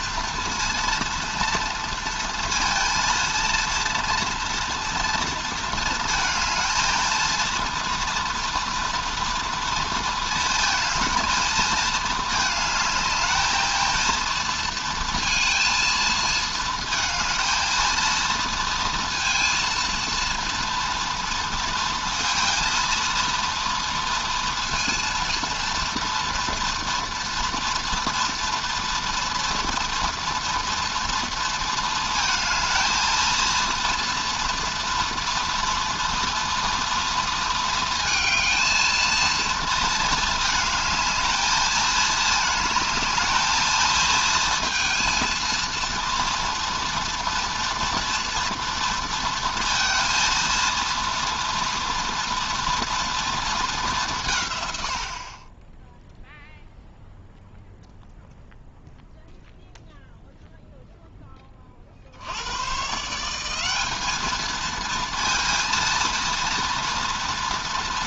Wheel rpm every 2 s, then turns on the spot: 230, 230, 230, 230, 240, 230, 220, 230, 220, 230, 240, 230, 230, 230, 240, 230, 230, 240, 230, 220, 220, 220, 230, 230, 230, 230, 230, 100, 0, 0, 0, 130, 230, 230.
none